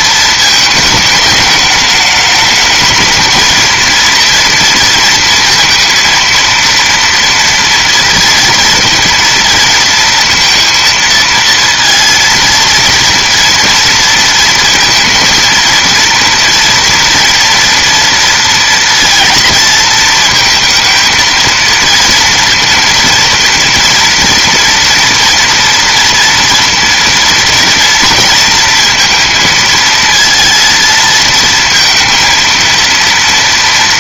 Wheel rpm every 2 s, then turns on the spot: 220, 210, 230, 230, 230, 230, 230, 230, 230, 230, 230, 230, 230, 230, 230, 230, 230.
none